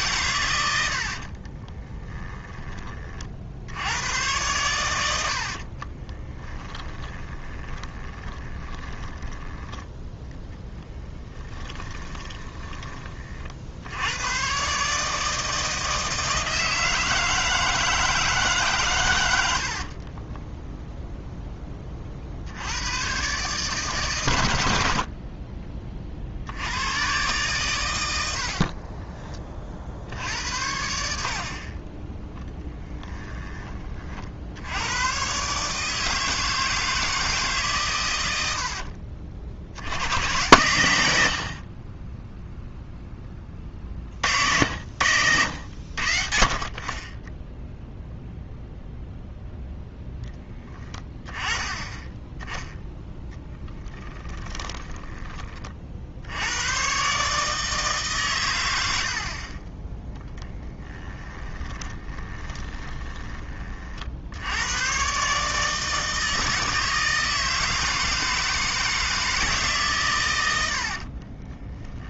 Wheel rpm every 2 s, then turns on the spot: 100, 30, 100, 10, 20, 10, 20, 140, 160, 140, 0, 90, 70, 90, 50, 80, 10, 90, 160, 60, 100, 0, 70, 30, 0, 10, 10, 10, 120, 90, 10, 10, 110, 160, 160, 80.
2-4 6-12 28-30 32-34 38-40 54-56 60-64 70-72